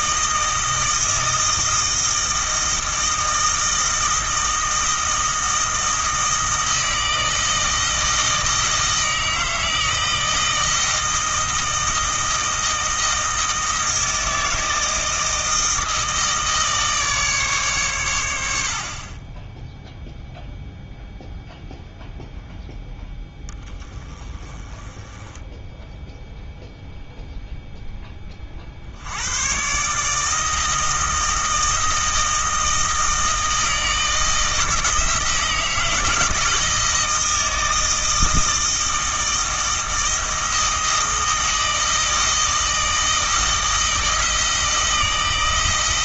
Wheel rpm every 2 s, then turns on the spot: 160, 160, 160, 160, 160, 160, 160, 160, 150, 60, 0, 0, 20, 0, 60, 160, 160, 160, 160, 160, 160, 160, 160.
none